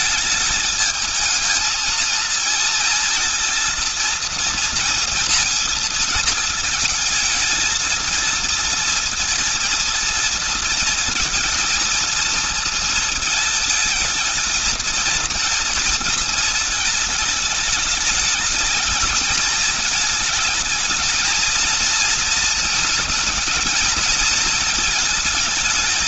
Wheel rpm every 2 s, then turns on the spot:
210, 230, 230, 220, 230, 230, 230, 220, 220, 220, 220, 230, 230.
none